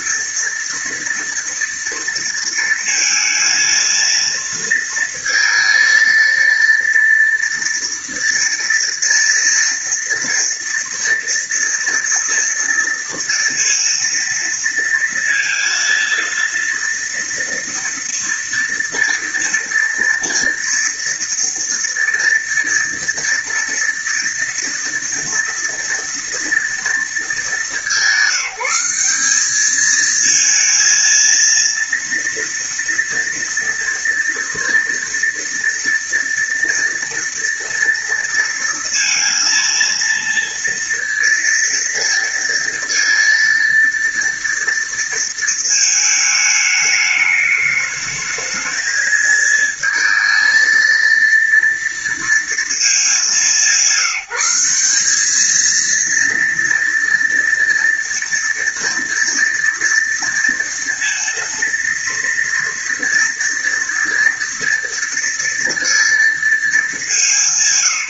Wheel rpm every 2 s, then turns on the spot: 230, 230, 230, 230, 230, 230, 230, 230, 230, 230, 230, 230, 230, 230, 190, 230, 230, 230, 230, 230, 230, 230, 230, 210, 220, 220, 230, 180, 230, 230, 230, 230, 230, 230.
none